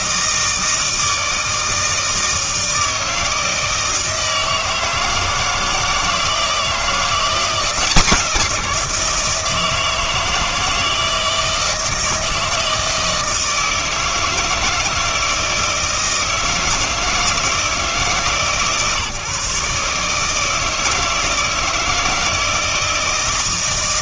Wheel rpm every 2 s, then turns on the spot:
160, 160, 160, 170, 170, 160, 160, 160, 160, 150, 160, 170.
none